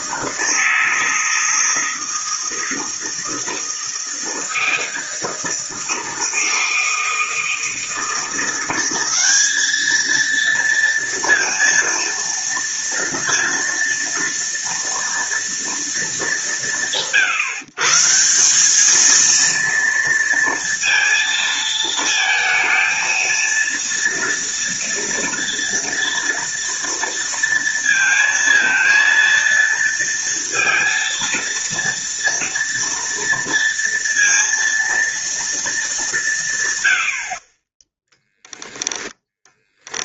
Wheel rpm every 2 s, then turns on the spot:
160, 160, 160, 160, 190, 230, 230, 230, 160, 220, 230, 230, 240, 230, 230, 230, 230, 230, 100, 10.
38-40